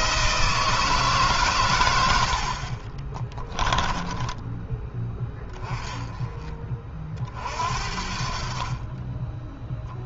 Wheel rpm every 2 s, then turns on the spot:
160, 50, 10, 30, 30.
2-4